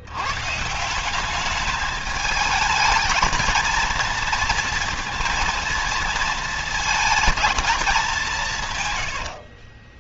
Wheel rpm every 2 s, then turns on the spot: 160, 220, 230, 220, 120.
none